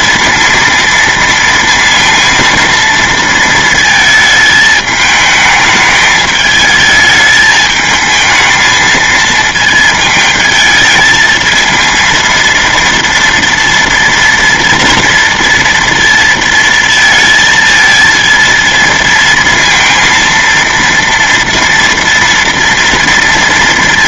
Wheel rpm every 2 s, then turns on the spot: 230, 230, 220, 220, 220, 220, 230, 230, 230, 230, 230, 240.
none